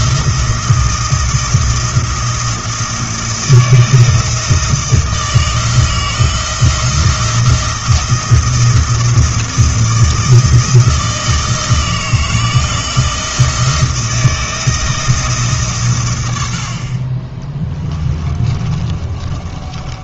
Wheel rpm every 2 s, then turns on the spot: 160, 160, 160, 170, 160, 160, 160, 160, 70, 30.
18-20